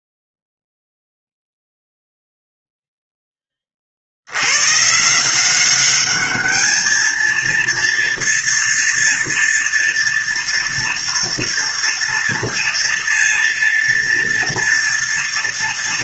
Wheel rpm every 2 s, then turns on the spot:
0, 0, 120, 220, 240, 230, 230, 230.
none